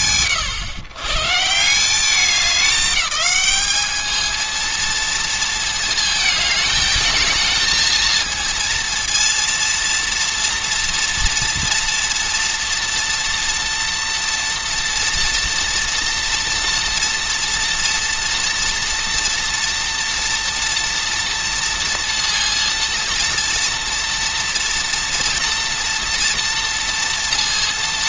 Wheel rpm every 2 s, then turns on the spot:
120, 210, 230, 220, 230, 240, 230, 240, 230, 230, 230, 230, 230, 230.
none